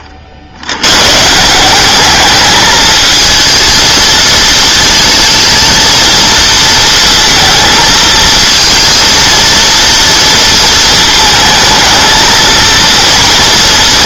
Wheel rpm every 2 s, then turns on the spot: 80, 220, 220, 230, 230, 230, 230.
none